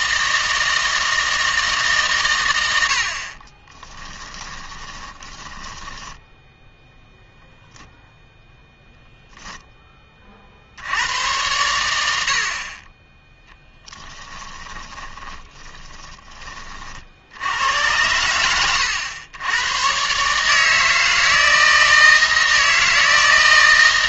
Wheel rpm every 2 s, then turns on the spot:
160, 100, 20, 0, 0, 70, 40, 20, 30, 90, 150, 160.
4-6 14-16